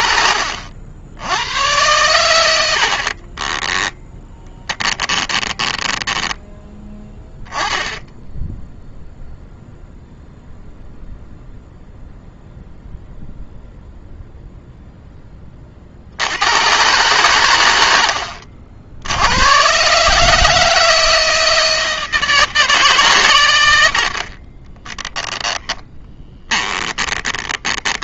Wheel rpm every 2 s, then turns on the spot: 80, 60, 10, 10, 0, 0, 0, 0, 110, 70, 160, 140, 10, 20.
2-6 24-28